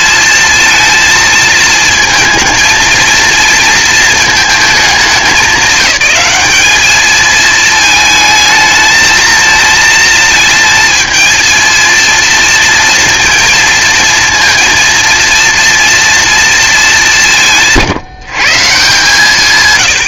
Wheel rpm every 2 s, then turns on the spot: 230, 230, 210, 210, 220, 230, 230, 230, 210, 150.
none